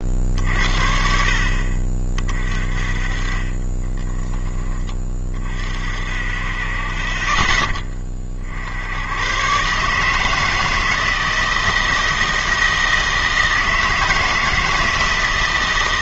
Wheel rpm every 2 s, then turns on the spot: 50, 30, 20, 30, 80, 160, 160, 160.
none